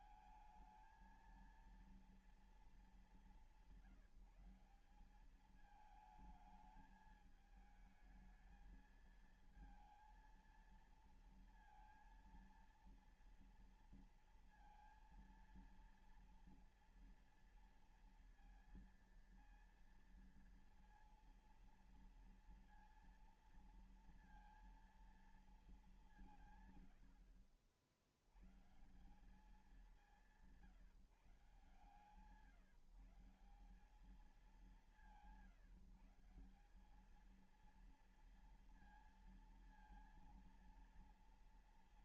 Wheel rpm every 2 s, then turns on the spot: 210, 220, 180, 220, 220, 230, 230, 230, 230, 230, 230, 230, 230, 160, 110, 160, 150, 190, 180, 230, 230.
none